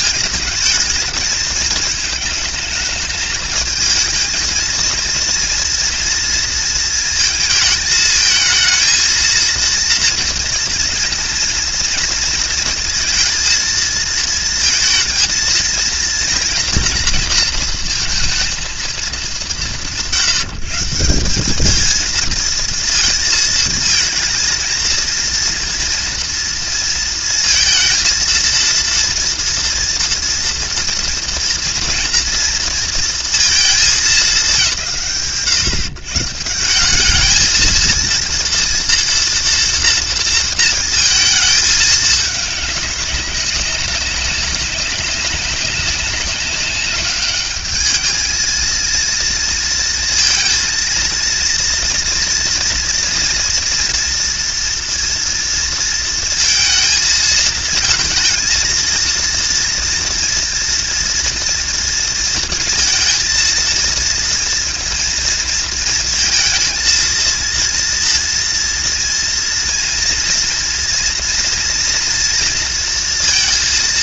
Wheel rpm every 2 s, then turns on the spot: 210, 210, 230, 230, 220, 230, 230, 230, 230, 220, 150, 230, 230, 230, 230, 240, 230, 140, 170, 230, 230, 200, 200, 200, 220, 230, 230, 230, 230, 230, 230, 230, 230, 230, 230, 230, 230.
none